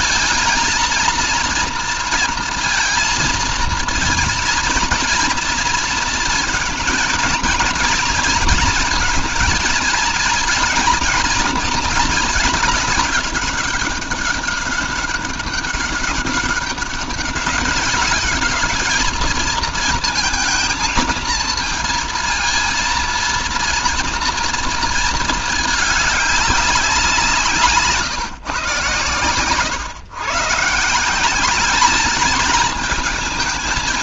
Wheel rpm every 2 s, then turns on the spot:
230, 230, 230, 240, 230, 220, 200, 200, 200, 220, 220, 230, 220, 170, 130, 190, 220.
none